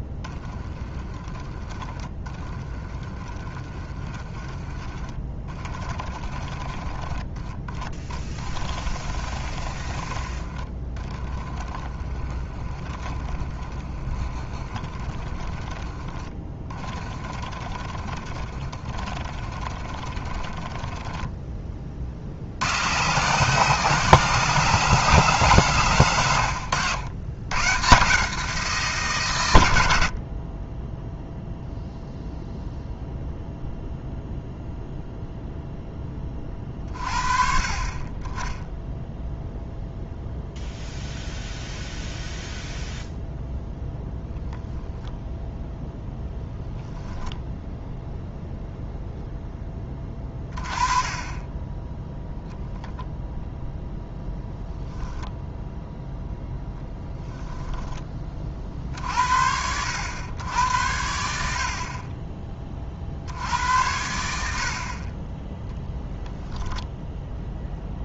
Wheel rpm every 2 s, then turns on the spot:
20, 20, 20, 20, 20, 20, 20, 30, 20, 20, 20, 120, 180, 90, 140, 10, 0, 0, 40, 10, 0, 0, 0, 0, 0, 30, 0, 10, 10, 60, 90, 40, 50, 0.
0-22